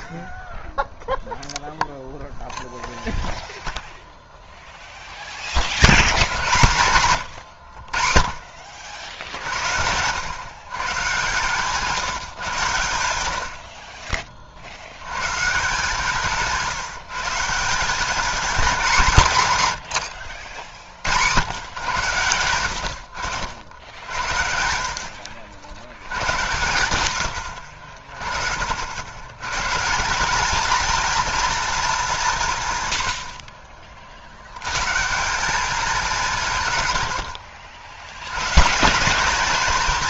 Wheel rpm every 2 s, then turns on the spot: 10, 0, 0, 120, 50, 130, 90, 60, 160, 210, 70, 100, 70, 90, 60, 220, 130, 110, 140, 140.
none